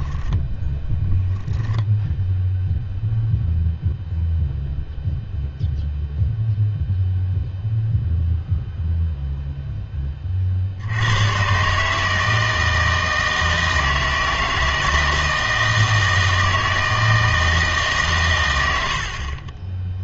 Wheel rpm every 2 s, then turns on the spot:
10, 0, 0, 0, 0, 60, 160, 160, 160, 80.
0-2